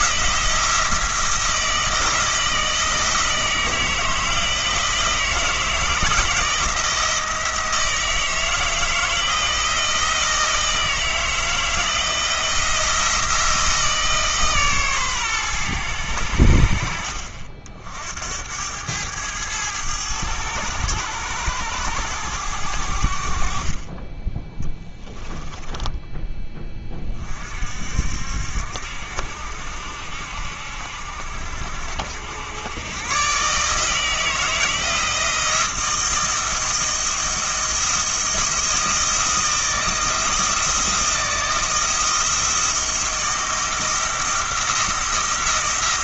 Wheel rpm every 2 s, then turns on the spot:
170, 160, 160, 160, 160, 160, 170, 140, 70, 90, 100, 90, 10, 20, 70, 70, 100, 160, 170, 170, 170, 160, 170.
24-26